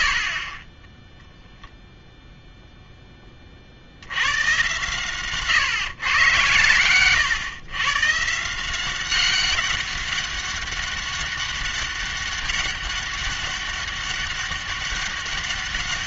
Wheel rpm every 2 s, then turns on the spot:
40, 0, 120, 120, 170, 200, 200, 200.
none